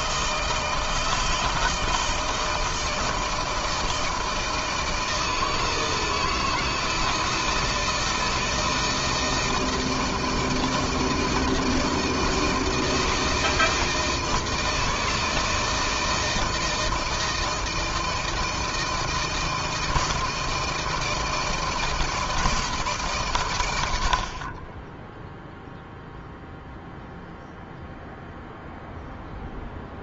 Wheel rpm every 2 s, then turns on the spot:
160, 160, 160, 160, 160, 160, 160, 160, 160, 160, 160, 160, 40, 0, 0.
none